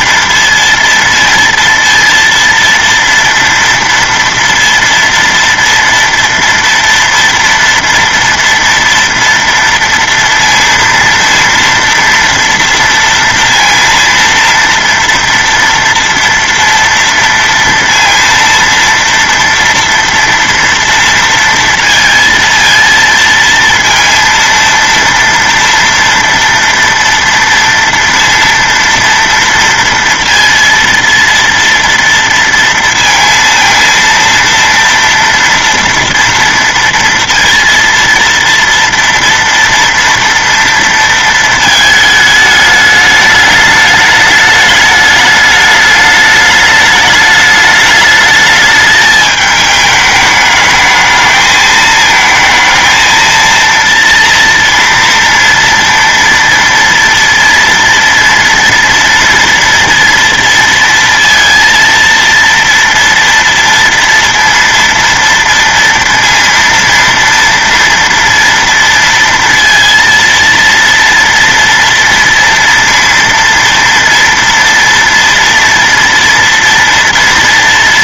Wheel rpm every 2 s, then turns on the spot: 230, 230, 230, 230, 230, 230, 230, 230, 230, 230, 230, 230, 230, 230, 230, 230, 230, 230, 230, 230, 230, 210, 210, 210, 210, 220, 230, 230, 230, 230, 230, 230, 230, 230, 230, 230, 230, 230, 230.
none